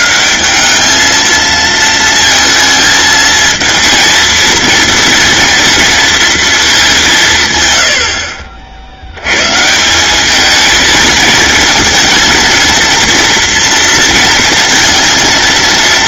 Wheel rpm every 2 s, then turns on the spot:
210, 220, 230, 200, 60, 220, 230, 230.
none